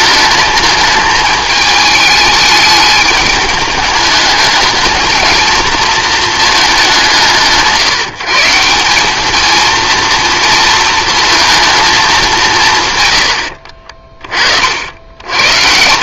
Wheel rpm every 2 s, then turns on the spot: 220, 210, 210, 220, 170, 230, 180, 50.
none